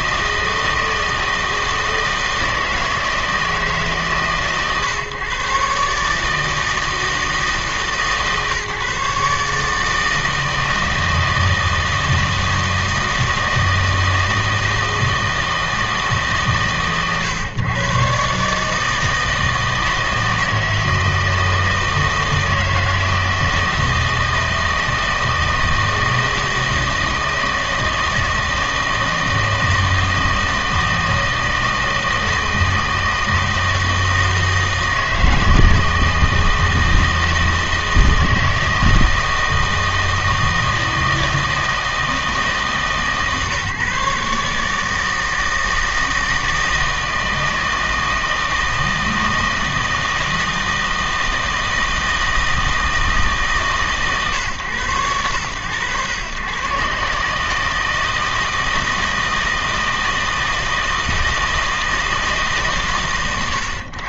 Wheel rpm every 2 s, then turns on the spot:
160, 160, 140, 160, 150, 160, 160, 160, 130, 150, 160, 160, 160, 160, 160, 160, 160, 160, 160, 160, 160, 160, 150, 160, 160, 160, 160, 120, 130, 160, 160, 140.
none